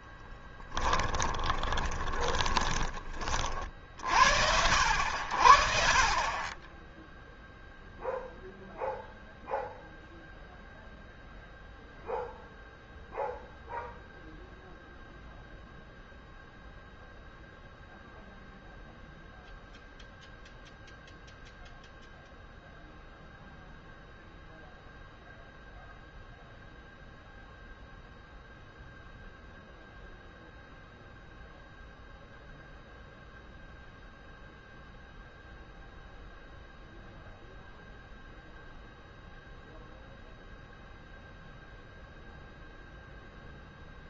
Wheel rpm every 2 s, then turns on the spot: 20, 20, 70, 10, 0, 0, 0, 0, 0, 0, 0, 0, 0, 0, 0, 0, 0, 0, 0, 0, 0, 0.
0-4